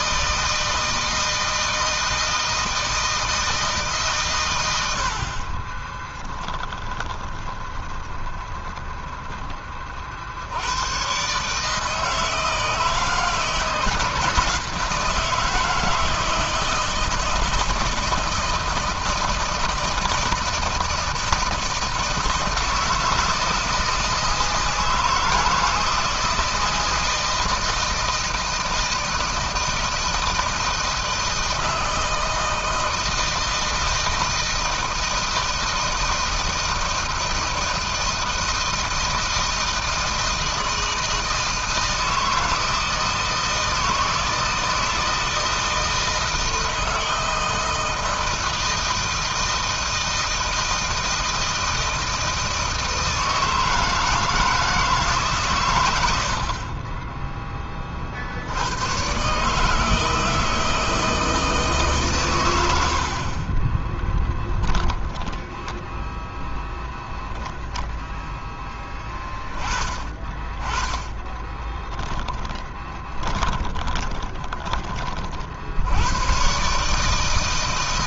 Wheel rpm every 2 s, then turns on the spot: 160, 160, 110, 20, 10, 80, 160, 160, 160, 160, 160, 160, 160, 160, 160, 160, 160, 160, 160, 160, 160, 160, 160, 160, 160, 160, 160, 160, 60, 70, 160, 100, 10, 0, 10, 20, 20, 20, 120.
6-10 62-64 72-76